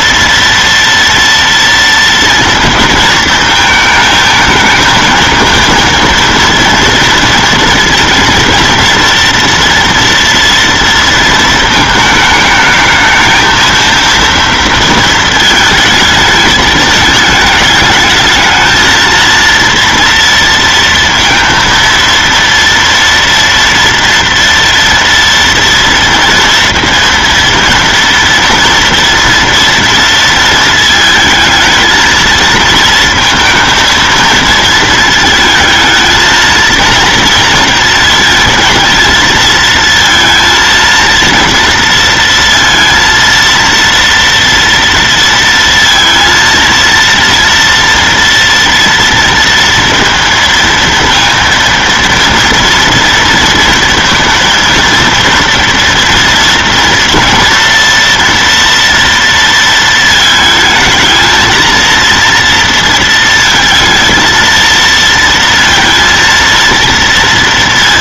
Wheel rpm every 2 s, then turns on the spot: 230, 220, 220, 230, 230, 230, 210, 230, 220, 220, 230, 230, 230, 230, 230, 220, 230, 220, 230, 230, 230, 230, 230, 230, 230, 230, 230, 230, 230, 230, 220, 230, 230, 230.
none